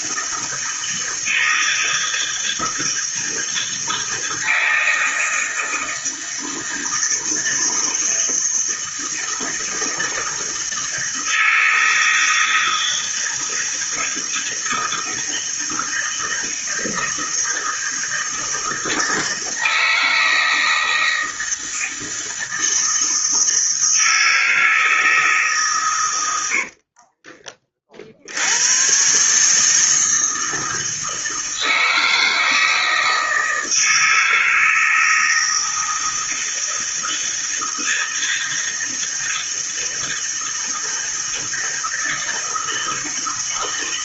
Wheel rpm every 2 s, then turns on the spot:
160, 160, 160, 160, 160, 160, 160, 160, 160, 160, 160, 160, 160, 60, 110, 160, 160, 160, 160, 160, 160, 160.
26-28